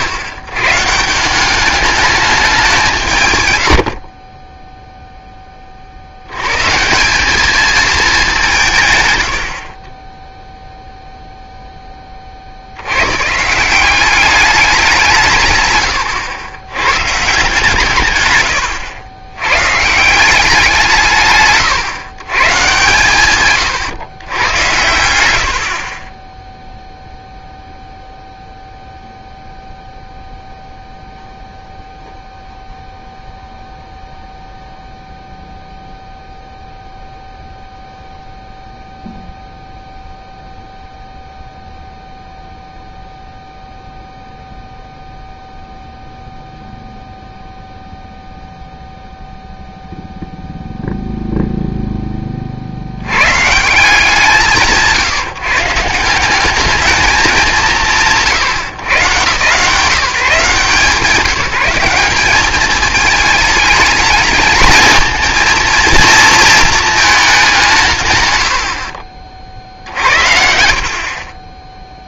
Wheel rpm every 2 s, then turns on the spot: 100, 190, 10, 150, 150, 0, 70, 200, 130, 110, 170, 130, 110, 0, 0, 0, 0, 0, 0, 0, 0, 0, 0, 0, 0, 0, 60, 150, 190, 150, 160, 210, 220, 220, 90, 60.
none